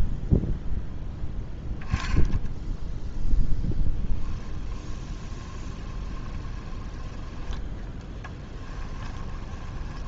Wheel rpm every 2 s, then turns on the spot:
0, 0, 20, 20, 20.
4-10